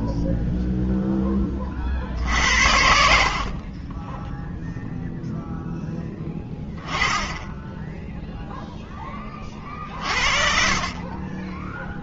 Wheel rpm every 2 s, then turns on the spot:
0, 40, 30, 10, 0, 60.
10-12